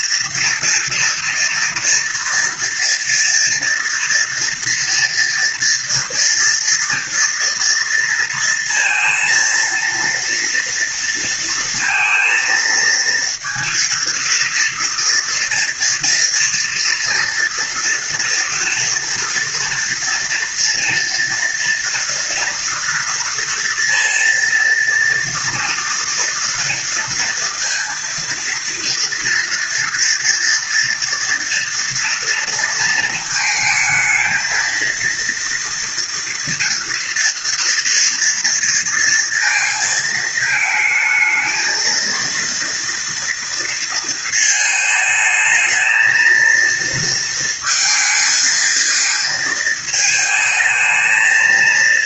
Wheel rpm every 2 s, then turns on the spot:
230, 230, 230, 230, 230, 230, 230, 230, 240, 230, 230, 230, 230, 230, 230, 230, 230, 230, 240, 230, 220, 230, 220, 230, 230, 220.
none